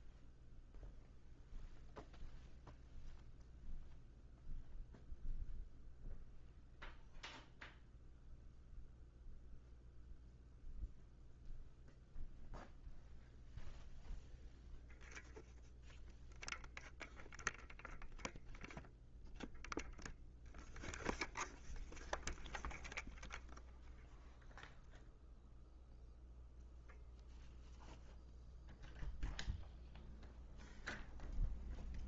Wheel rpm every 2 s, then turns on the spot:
0, 0, 0, 0, 0, 0, 0, 0, 0, 0, 0, 0, 0, 0, 0, 0.
none